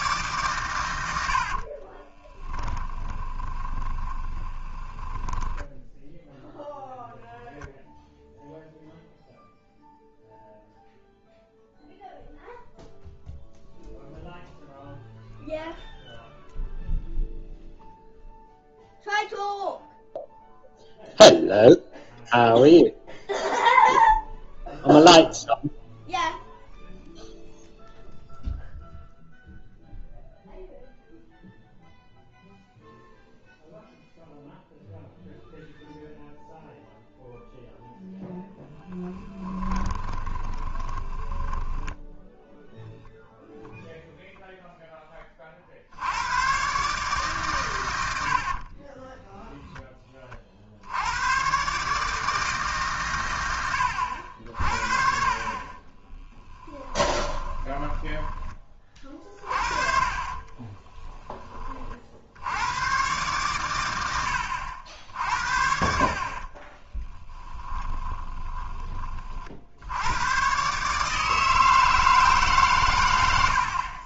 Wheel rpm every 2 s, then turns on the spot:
100, 10, 20, 0, 0, 0, 0, 0, 0, 0, 0, 0, 0, 0, 0, 0, 0, 0, 0, 10, 20, 0, 0, 130, 30, 70, 150, 50, 10, 30, 10, 110, 80, 20, 20, 140, 120.
2-6 40-42 48-50 56-58 60-62 66-68